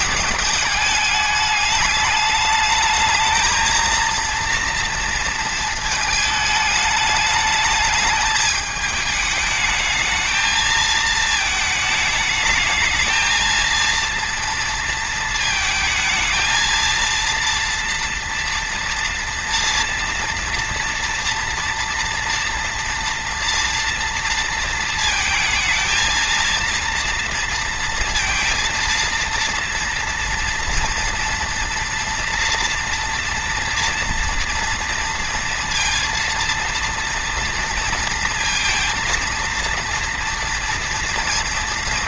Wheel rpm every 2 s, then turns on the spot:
210, 220, 230, 210, 210, 220, 220, 230, 230, 230, 230, 230, 230, 230, 230, 230, 240, 230, 230, 230, 230.
none